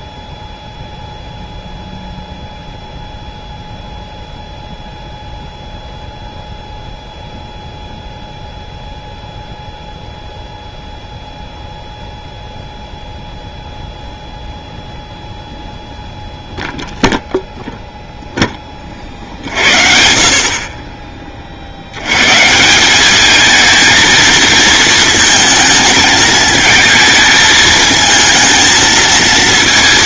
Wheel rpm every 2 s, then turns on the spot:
0, 0, 0, 0, 0, 0, 0, 0, 0, 30, 30, 180, 220, 220, 220.
none